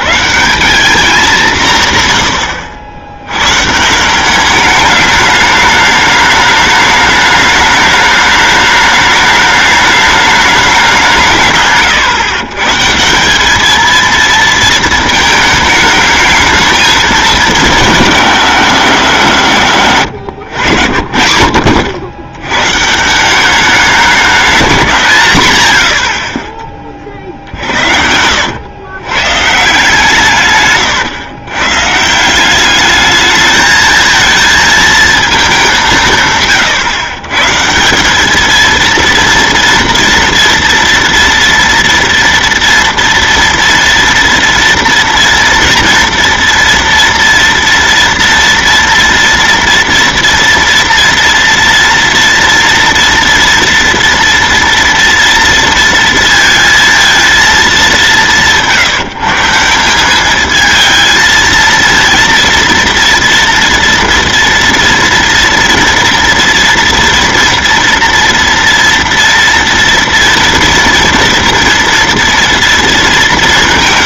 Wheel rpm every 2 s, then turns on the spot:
190, 80, 210, 210, 210, 200, 130, 230, 220, 190, 90, 120, 180, 30, 100, 130, 200, 220, 130, 220, 230, 240, 230, 230, 230, 230, 230, 230, 230, 170, 220, 230, 230, 230, 230, 230, 230.
none